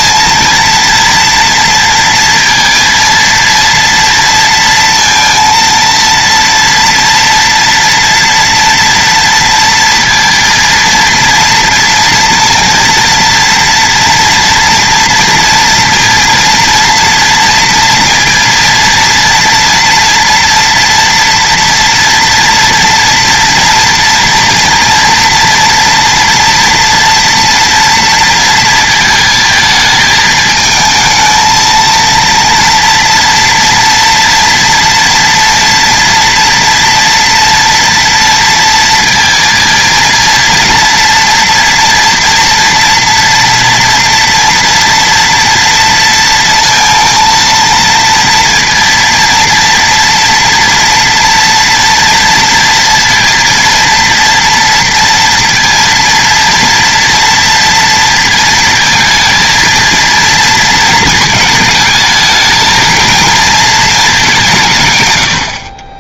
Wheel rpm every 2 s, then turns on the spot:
230, 230, 230, 230, 230, 230, 230, 230, 230, 230, 230, 230, 230, 230, 230, 220, 230, 230, 230, 230, 230, 230, 230, 230, 240, 240, 230, 230, 230, 230, 230, 220, 170.
none